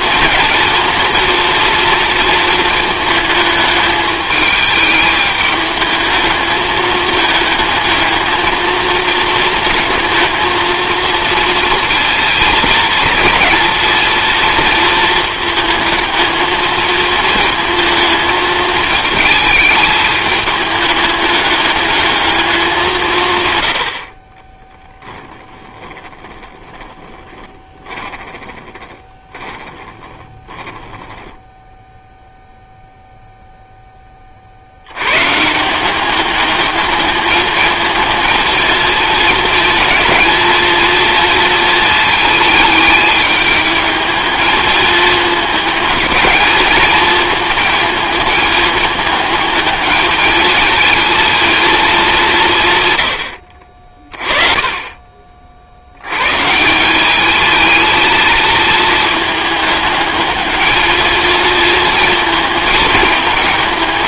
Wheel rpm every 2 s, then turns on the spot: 230, 220, 220, 220, 220, 230, 230, 230, 220, 220, 210, 180, 10, 20, 20, 10, 0, 90, 210, 220, 230, 220, 210, 210, 210, 220, 140, 30, 180, 220, 220, 220.
24-32